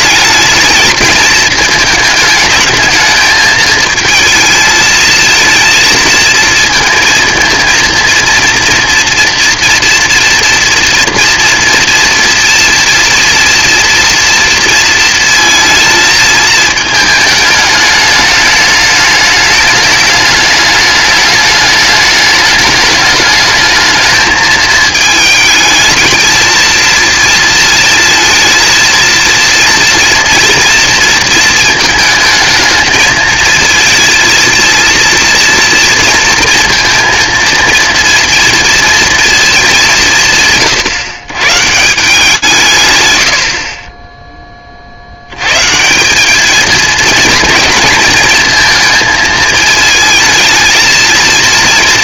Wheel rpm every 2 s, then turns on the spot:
220, 220, 220, 230, 230, 230, 230, 230, 220, 210, 210, 210, 220, 220, 230, 230, 220, 230, 230, 230, 150, 140, 30, 220, 230, 220.
none